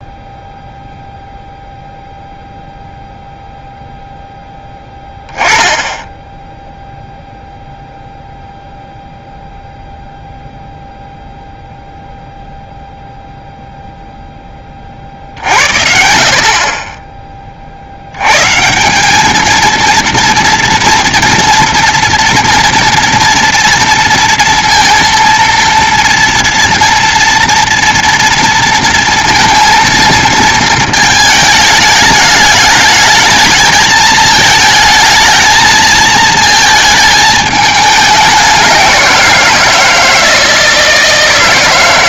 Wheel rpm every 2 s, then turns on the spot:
0, 0, 0, 0, 0, 0, 0, 10, 50, 140, 230, 230, 230, 230, 230, 220, 210, 220, 220, 190, 160.
none